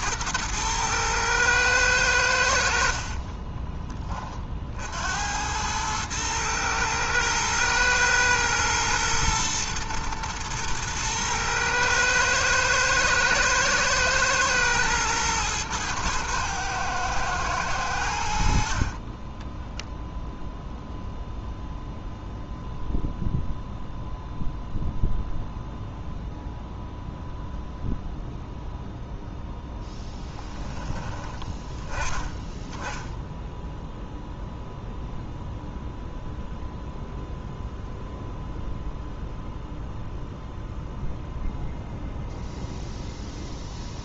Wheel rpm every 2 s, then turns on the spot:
110, 70, 50, 110, 110, 110, 120, 120, 110, 60, 0, 0, 0, 0, 0, 10, 10, 0, 0, 0, 0, 0.
none